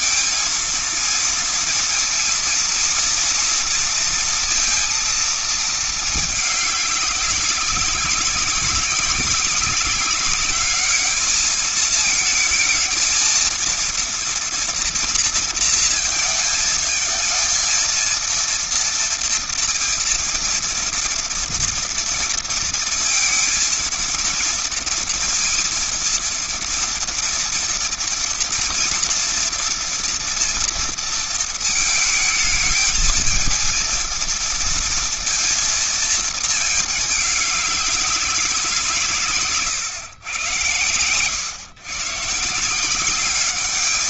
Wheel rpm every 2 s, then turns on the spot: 230, 230, 230, 210, 200, 200, 220, 230, 230, 230, 230, 230, 230, 230, 230, 230, 220, 230, 220, 190, 110, 160.
none